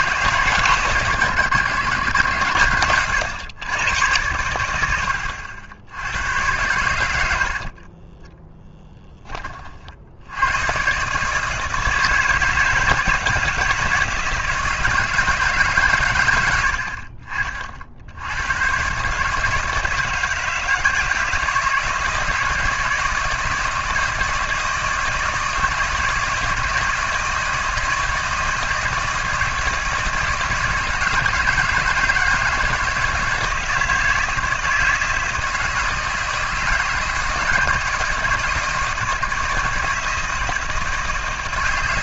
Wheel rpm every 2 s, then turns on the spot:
120, 90, 90, 90, 10, 130, 160, 160, 70, 120, 160, 160, 160, 160, 160, 160, 160, 160, 160, 160, 160.
2-4